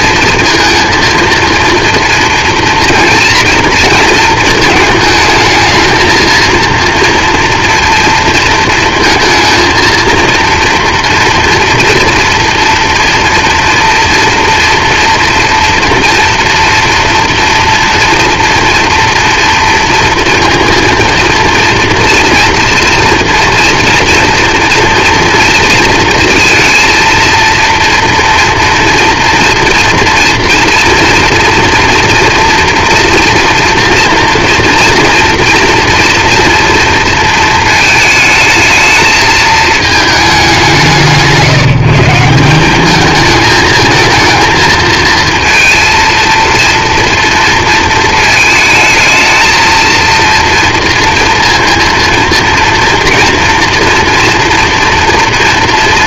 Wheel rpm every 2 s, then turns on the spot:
230, 230, 230, 230, 230, 230, 230, 240, 230, 230, 230, 230, 230, 230, 240, 240, 240, 230, 240, 220, 190, 190, 220, 230, 220, 230, 230, 240.
none